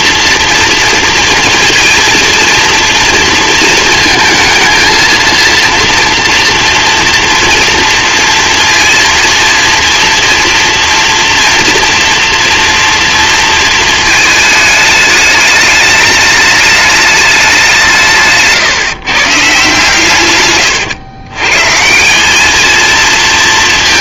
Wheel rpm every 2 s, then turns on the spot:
230, 230, 220, 230, 230, 230, 230, 210, 210, 150, 110, 220.
none